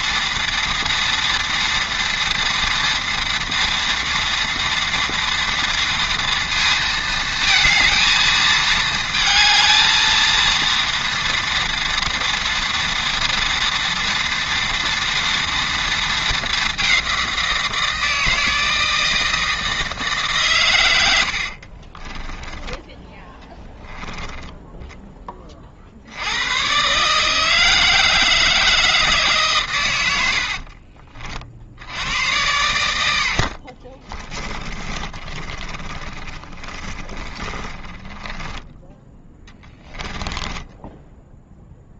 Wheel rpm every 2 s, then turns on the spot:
230, 230, 230, 230, 220, 230, 230, 230, 200, 160, 130, 10, 10, 120, 160, 50, 100, 20, 30, 20, 10.
30-32 34-38 40-42